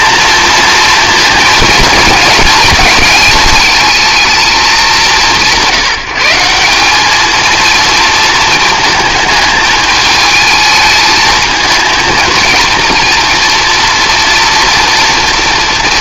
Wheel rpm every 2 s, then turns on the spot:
230, 210, 200, 200, 220, 220, 230, 230.
none